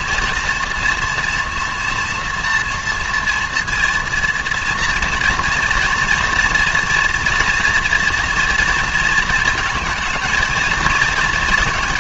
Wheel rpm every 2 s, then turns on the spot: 240, 230, 230, 230, 230, 220.
none